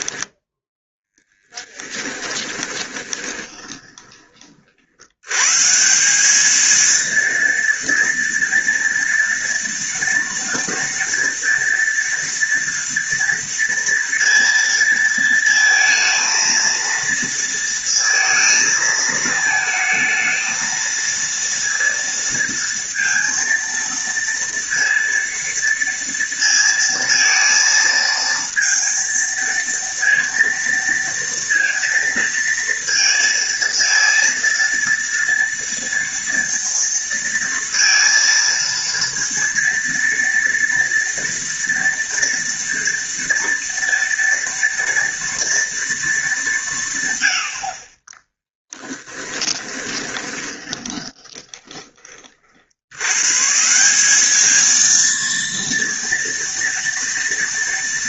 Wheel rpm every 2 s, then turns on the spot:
10, 20, 90, 230, 230, 230, 230, 230, 230, 220, 230, 230, 230, 230, 230, 230, 230, 230, 230, 230, 230, 230, 230, 120, 20, 20, 120, 230, 220.
0-4 48-52